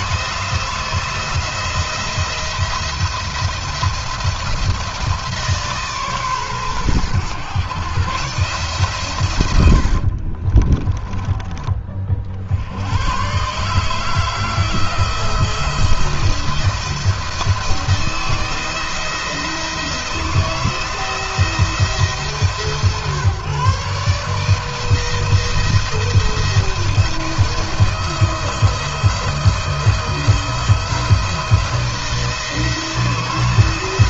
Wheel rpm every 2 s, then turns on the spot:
170, 170, 170, 130, 140, 40, 70, 160, 170, 170, 170, 150, 160, 170, 170, 170, 160.
10-12